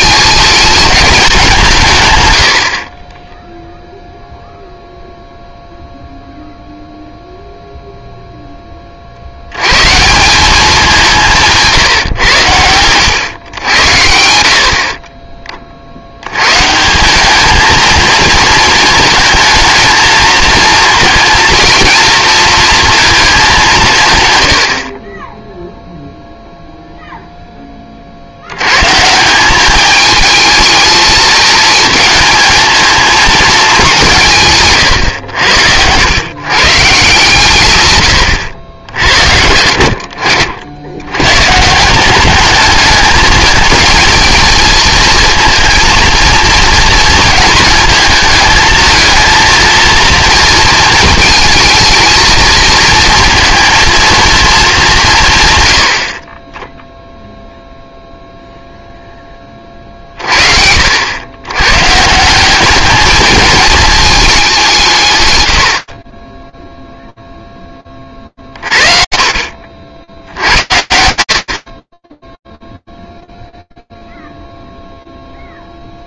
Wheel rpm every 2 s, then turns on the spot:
220, 40, 0, 0, 30, 200, 100, 50, 160, 220, 230, 230, 70, 0, 120, 220, 220, 130, 130, 80, 70, 210, 220, 230, 220, 220, 230, 200, 10, 0, 70, 210, 160, 0, 50, 70, 0, 0.
2-4 68-70